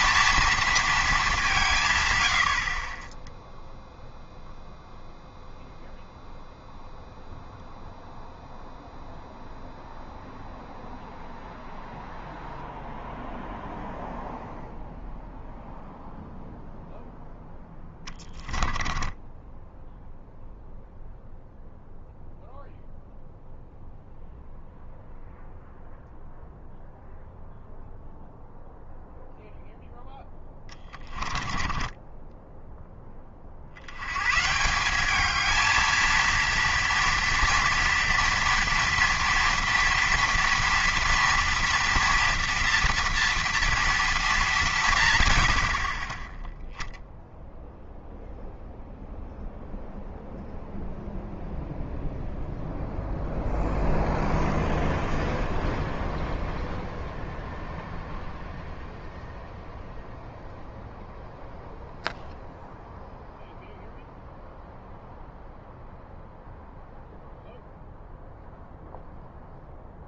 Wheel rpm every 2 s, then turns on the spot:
230, 50, 0, 0, 0, 0, 0, 0, 0, 10, 0, 0, 0, 0, 0, 20, 10, 160, 230, 230, 230, 240, 200, 10, 0, 0, 0, 0, 0, 0, 0, 0, 0, 0, 0.
18-20 30-32